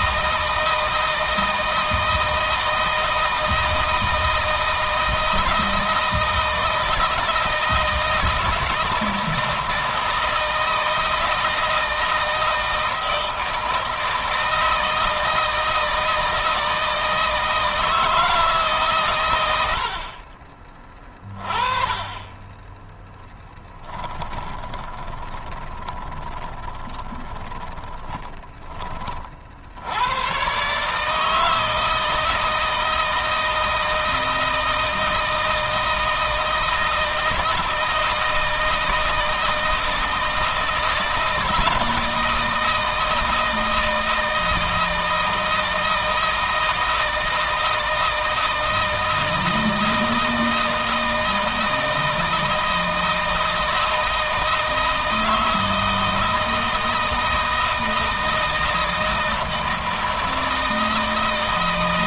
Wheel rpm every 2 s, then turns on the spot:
160, 160, 160, 160, 160, 160, 160, 160, 160, 130, 30, 10, 20, 20, 30, 150, 160, 160, 160, 160, 160, 160, 160, 160, 160, 160, 160, 160, 160, 160, 160.
24-28